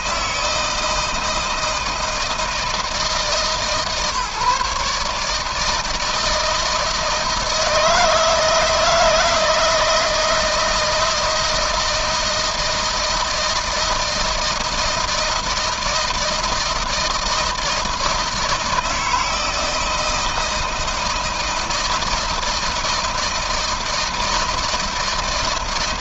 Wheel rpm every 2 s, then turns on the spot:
160, 160, 140, 160, 160, 160, 160, 160, 160, 160, 160, 160, 160.
none